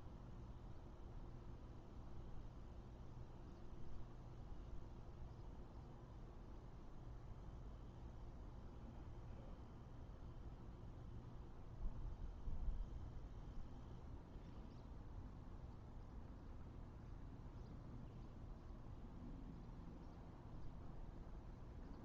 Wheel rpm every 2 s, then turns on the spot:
0, 0, 0, 0, 0, 0, 0, 0, 0, 0, 0.
none